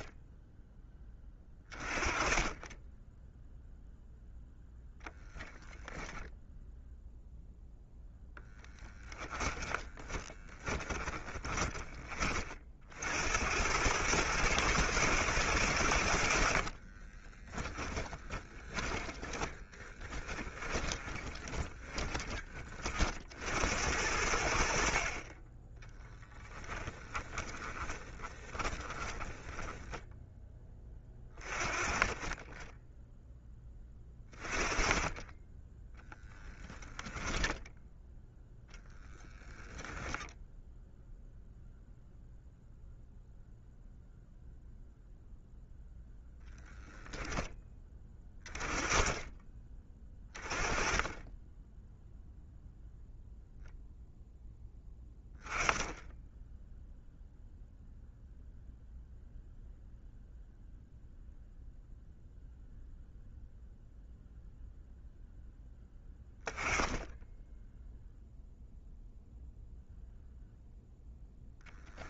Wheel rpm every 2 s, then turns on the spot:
10, 10, 0, 0, 10, 20, 50, 110, 40, 10, 20, 30, 60, 20, 10, 20, 10, 30, 10, 0, 0, 0, 0, 10, 30, 20, 0, 10, 0, 0, 0, 0, 0, 10, 0, 0.
8-12 16-22 26-30